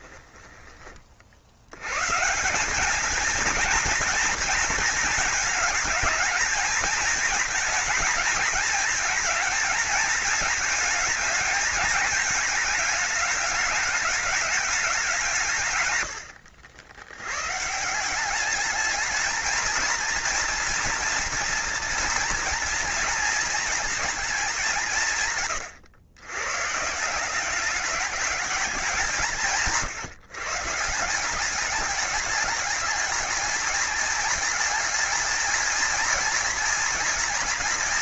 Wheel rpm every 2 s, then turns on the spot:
30, 210, 230, 220, 220, 210, 210, 200, 80, 210, 230, 230, 170, 160, 200, 170, 210, 220, 230.
none